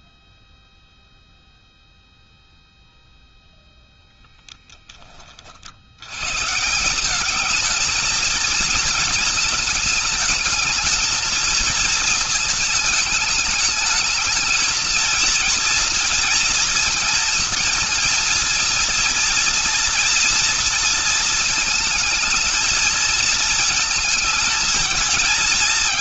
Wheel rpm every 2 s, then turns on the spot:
0, 0, 10, 160, 220, 220, 220, 230, 230, 230, 230, 220, 220.
none